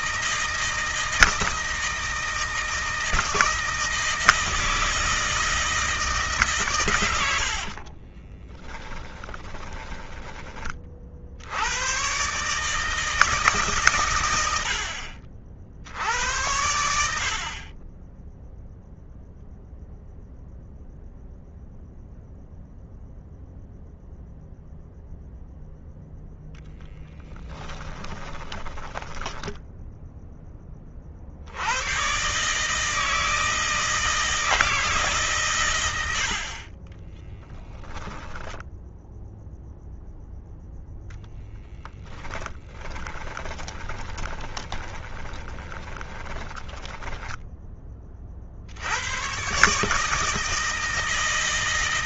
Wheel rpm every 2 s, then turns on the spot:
160, 160, 160, 120, 10, 30, 150, 70, 80, 0, 0, 0, 0, 0, 20, 20, 150, 150, 20, 0, 0, 20, 20, 10, 80, 160.
8-10 28-30 36-38 42-48